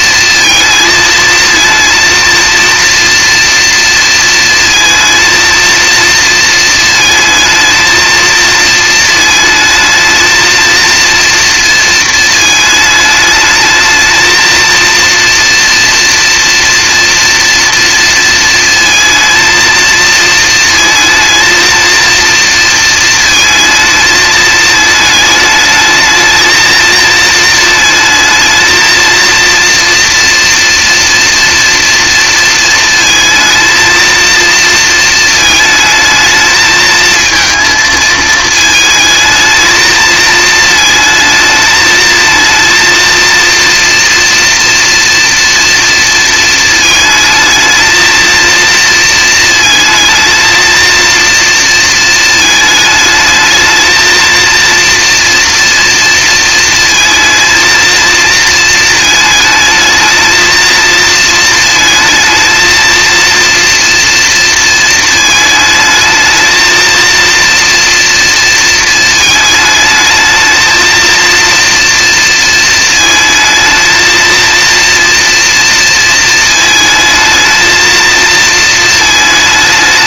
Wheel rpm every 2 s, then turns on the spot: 230, 230, 230, 230, 230, 220, 220, 230, 230, 230, 230, 230, 220, 220, 220, 240, 230, 230, 220, 220, 220, 230, 230, 230, 230, 230, 220, 230, 230, 230, 220, 230, 230, 220, 230, 220, 230, 230, 220, 230.
none